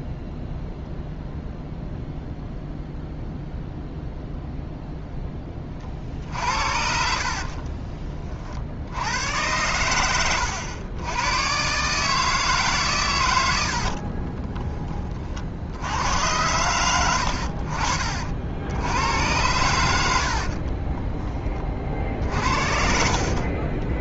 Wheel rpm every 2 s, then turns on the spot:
0, 0, 0, 60, 50, 90, 150, 30, 110, 70, 40, 50.
6-8 14-16 20-24